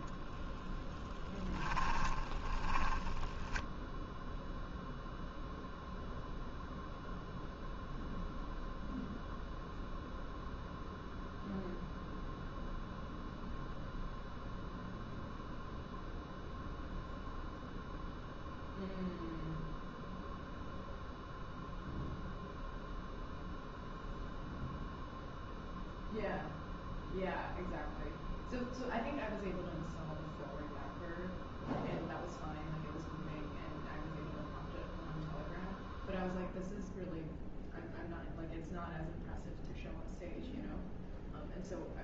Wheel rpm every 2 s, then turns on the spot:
10, 20, 0, 0, 0, 0, 0, 0, 0, 0, 0, 0, 0, 0, 0, 0, 0, 0, 0, 0, 0.
2-4